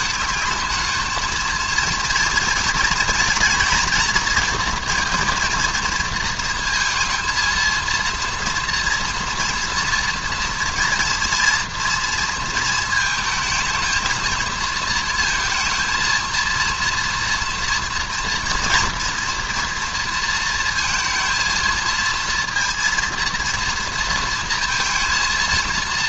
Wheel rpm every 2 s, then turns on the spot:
220, 230, 230, 220, 230, 230, 230, 230, 230, 230, 230, 230, 230.
none